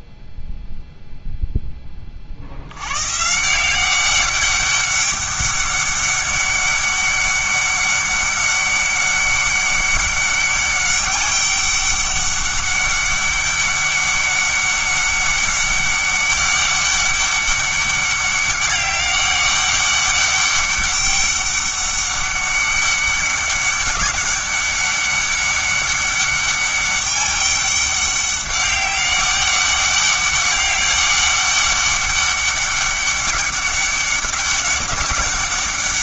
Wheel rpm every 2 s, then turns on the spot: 0, 90, 200, 200, 200, 200, 200, 200, 200, 200, 200, 200, 200, 200, 200, 200, 200, 200.
none